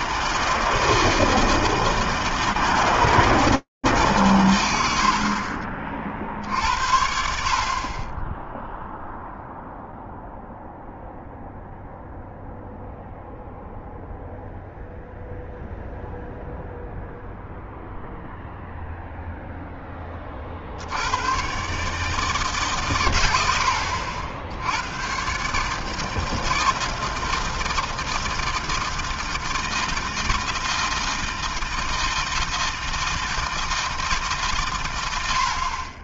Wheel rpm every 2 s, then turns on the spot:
160, 160, 100, 60, 10, 0, 0, 0, 0, 0, 30, 150, 70, 160, 160, 160, 160, 150.
none